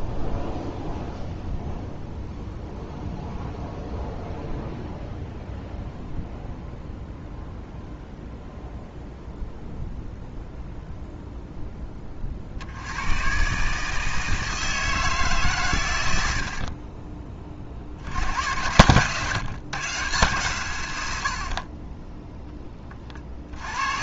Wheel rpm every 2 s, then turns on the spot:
0, 0, 0, 0, 0, 0, 70, 160, 50, 120, 120, 20.
none